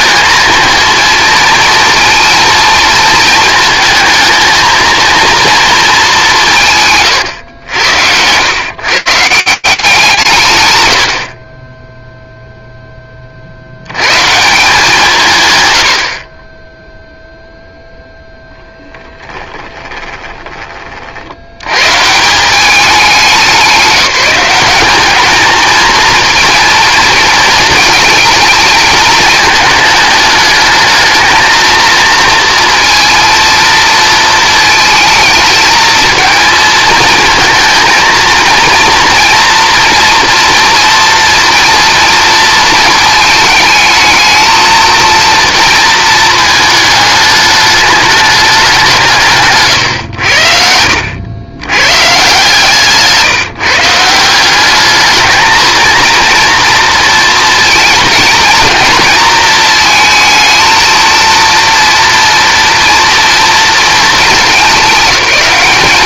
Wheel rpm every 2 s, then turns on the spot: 220, 220, 220, 170, 130, 100, 0, 160, 10, 10, 60, 200, 200, 230, 220, 220, 230, 220, 220, 230, 230, 230, 230, 210, 160, 80, 150, 210, 230, 230, 230, 230, 200.
18-20